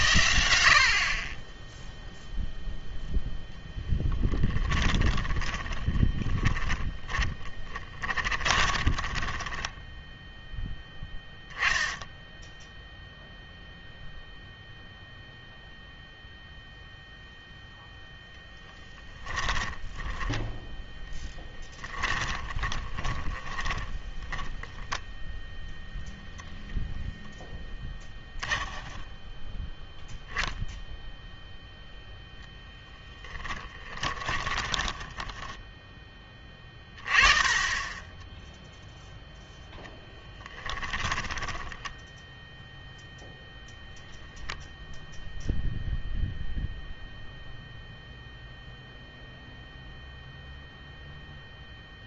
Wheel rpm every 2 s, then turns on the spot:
60, 0, 10, 10, 20, 0, 0, 0, 0, 10, 10, 20, 10, 0, 10, 0, 0, 20, 30, 0, 10, 0, 0, 0, 0, 0.
4-10 18-20 22-24 34-36 40-42